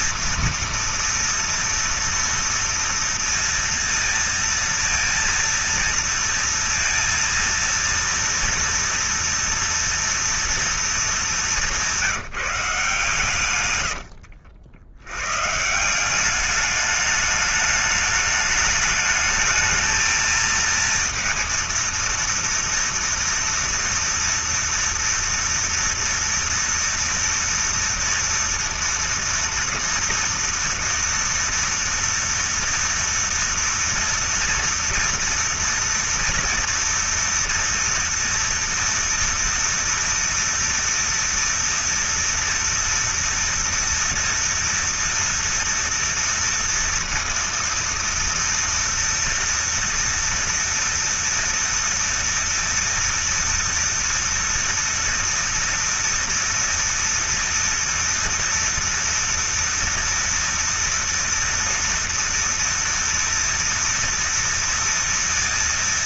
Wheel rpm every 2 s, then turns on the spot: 230, 240, 230, 230, 230, 230, 180, 70, 190, 210, 220, 230, 230, 230, 240, 230, 230, 230, 230, 230, 230, 230, 230, 230, 230, 230, 230, 230, 230, 230, 230, 230, 230.
14-16